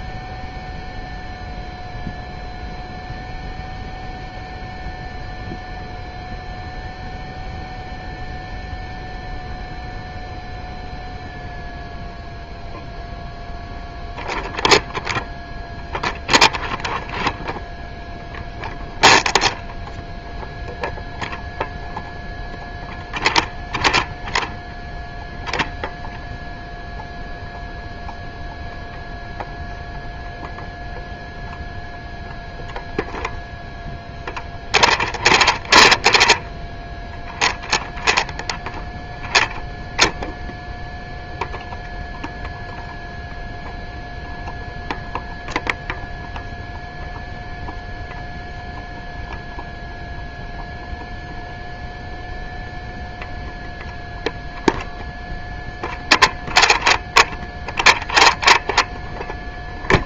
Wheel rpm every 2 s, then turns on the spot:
0, 0, 0, 0, 0, 0, 0, 0, 0, 0, 0, 0, 0, 0, 0, 0, 0, 0, 0, 0, 0, 0, 0, 0, 0, 0, 0, 0, 0, 0.
none